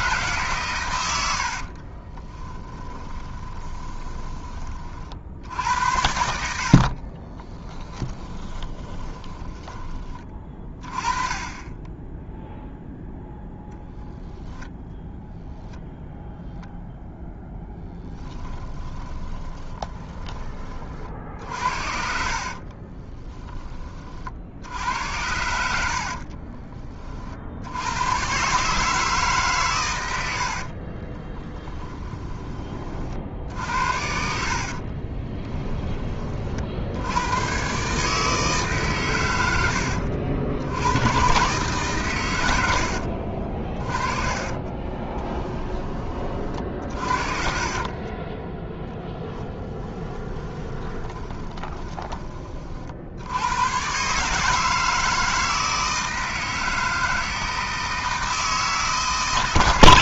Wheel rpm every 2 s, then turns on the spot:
120, 10, 30, 60, 30, 30, 10, 10, 0, 10, 30, 40, 70, 30, 140, 50, 30, 50, 70, 140, 90, 80, 20, 50, 10, 20, 50, 160, 160, 160.
2-4 8-10 18-20 22-24 30-32 34-36 44-52